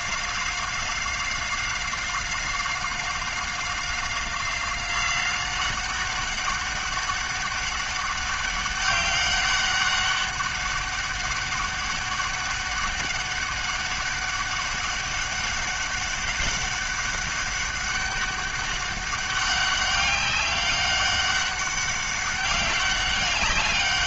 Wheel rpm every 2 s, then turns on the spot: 190, 190, 190, 200, 200, 190, 190, 200, 200, 190, 200, 190.
none